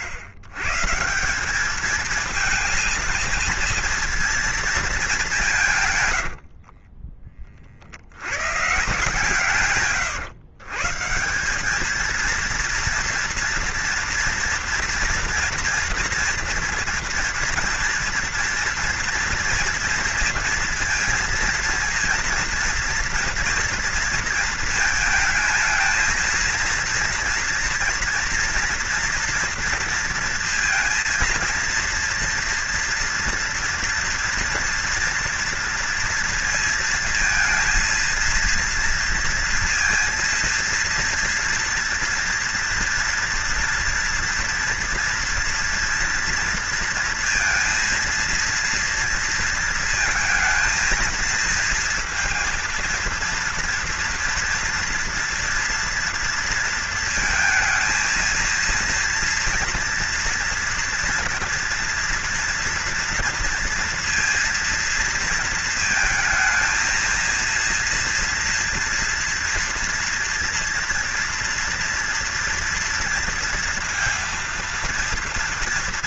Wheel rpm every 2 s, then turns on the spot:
120, 230, 230, 50, 140, 120, 230, 230, 230, 230, 230, 230, 220, 230, 230, 230, 230, 230, 230, 230, 230, 240, 230, 230, 230, 220, 230, 230, 230, 230, 230, 230, 230, 230, 230, 230, 240, 230.
6-8